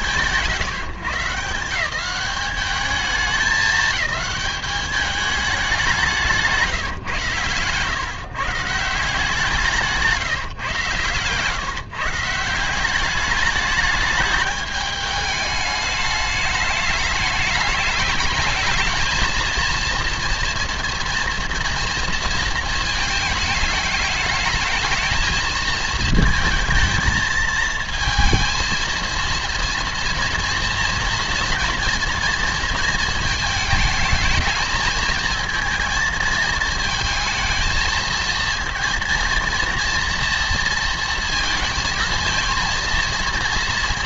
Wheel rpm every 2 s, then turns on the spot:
130, 190, 210, 170, 160, 140, 180, 210, 210, 220, 230, 220, 210, 220, 230, 230, 230, 220, 220, 230, 230, 230.
6-8